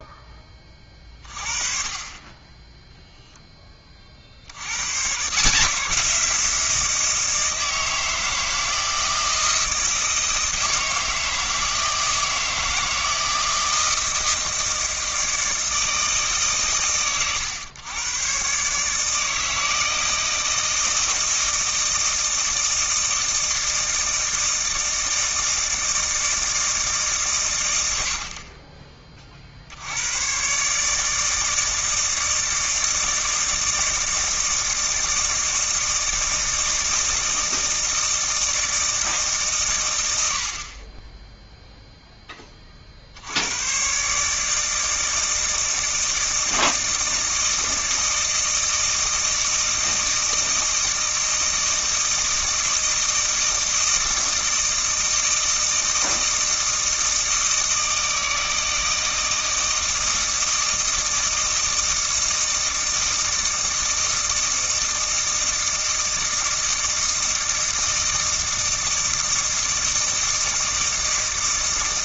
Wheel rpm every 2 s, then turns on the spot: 30, 10, 100, 170, 160, 160, 160, 160, 130, 150, 160, 160, 160, 150, 30, 150, 160, 160, 160, 160, 40, 40, 160, 160, 160, 160, 160, 160, 160, 160, 160, 160, 160, 160, 160, 160.
none